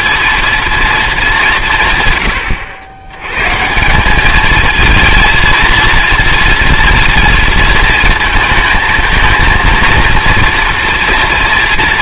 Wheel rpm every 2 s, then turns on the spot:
230, 90, 220, 230, 220, 230.
none